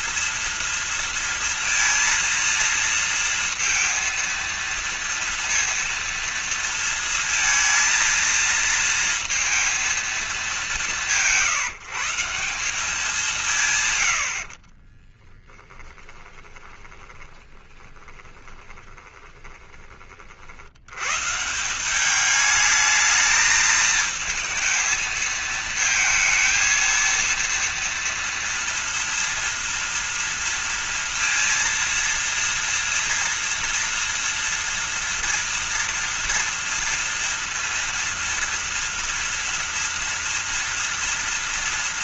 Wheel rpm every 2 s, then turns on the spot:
230, 230, 230, 230, 230, 190, 200, 50, 20, 20, 100, 220, 220, 230, 230, 230, 230, 230, 230, 230, 230.
14-20